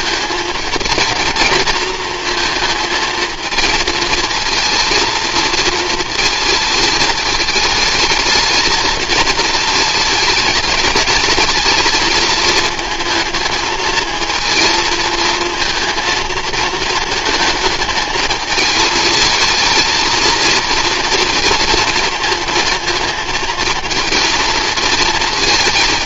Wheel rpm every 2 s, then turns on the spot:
230, 230, 230, 220, 220, 210, 220, 230, 220, 230, 230, 230, 230.
none